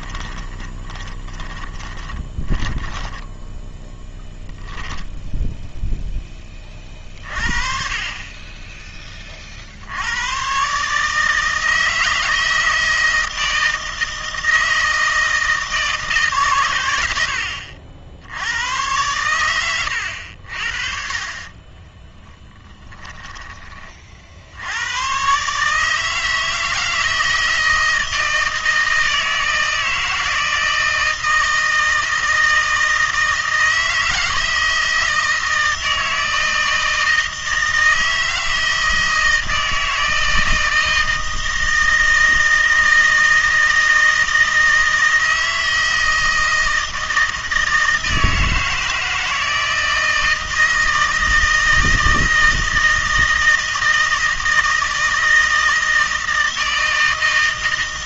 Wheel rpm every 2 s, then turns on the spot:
20, 10, 0, 40, 50, 160, 160, 160, 80, 100, 40, 20, 140, 160, 160, 160, 160, 160, 160, 160, 160, 160, 160, 160, 160, 160, 160, 160, 160.
0-2 20-22